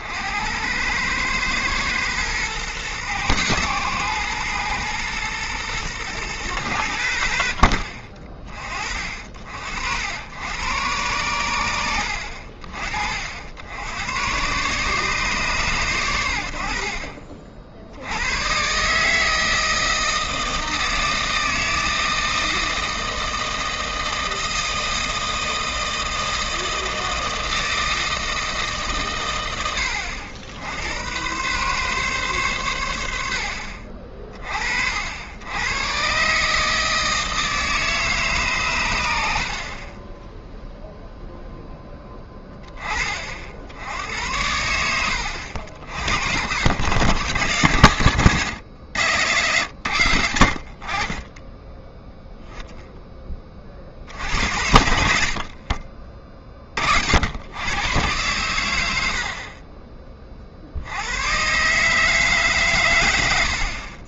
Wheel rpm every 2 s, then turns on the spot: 90, 120, 120, 100, 40, 110, 50, 130, 60, 120, 160, 160, 160, 160, 150, 90, 100, 50, 150, 120, 0, 10, 80, 90, 120, 60, 0, 80, 40, 100, 60, 130.
none